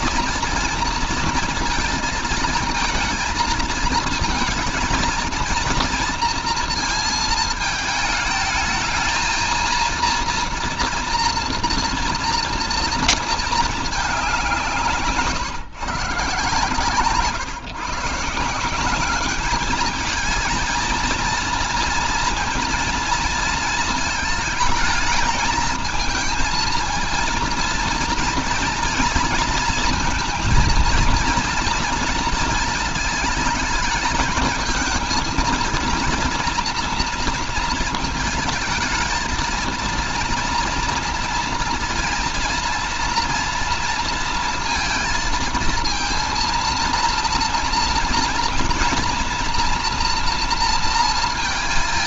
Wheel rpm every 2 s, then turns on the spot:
230, 230, 230, 230, 220, 230, 230, 170, 140, 180, 230, 230, 220, 230, 230, 230, 230, 220, 230, 220, 230, 230, 230, 230, 230, 230.
none